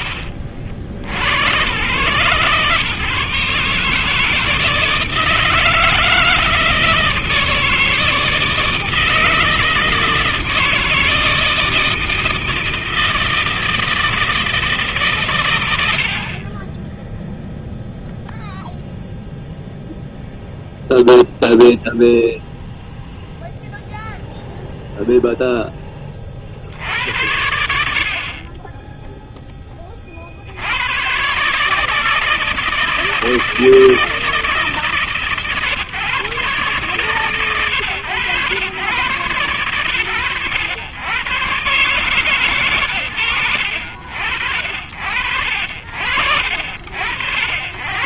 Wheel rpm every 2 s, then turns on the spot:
60, 130, 160, 160, 160, 160, 160, 160, 40, 0, 0, 0, 0, 50, 30, 60, 160, 160, 140, 110, 100, 130, 70, 80.
none